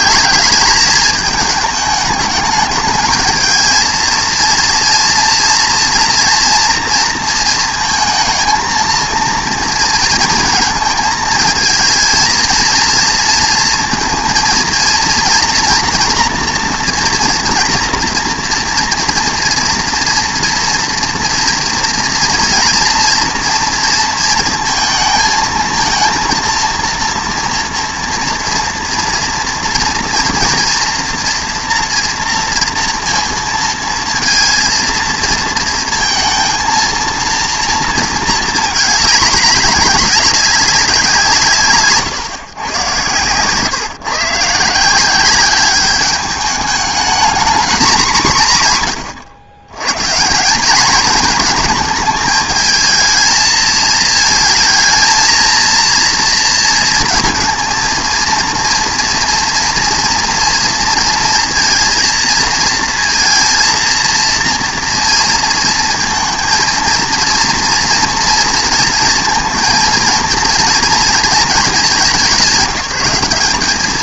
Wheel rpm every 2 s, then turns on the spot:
210, 210, 230, 230, 220, 230, 230, 230, 240, 230, 230, 240, 230, 230, 230, 230, 230, 230, 230, 220, 200, 140, 160, 210, 170, 190, 220, 220, 230, 230, 230, 230, 230, 230, 230, 230, 180.
none